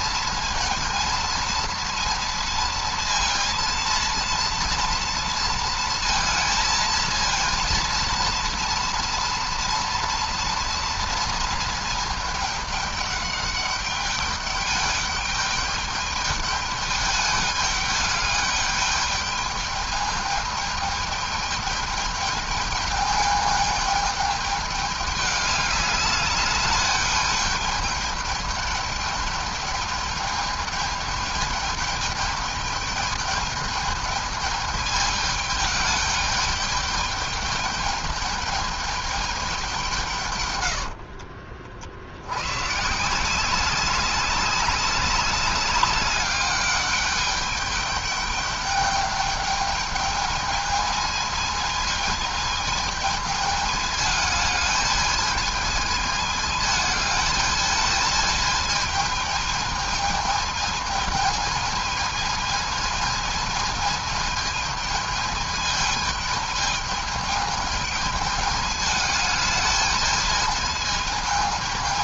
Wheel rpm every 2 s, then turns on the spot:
230, 230, 230, 220, 230, 230, 210, 210, 210, 210, 210, 210, 210, 210, 210, 210, 210, 210, 210, 210, 110, 130, 200, 200, 210, 220, 220, 210, 220, 220, 220, 220, 220, 210, 210, 220.
40-42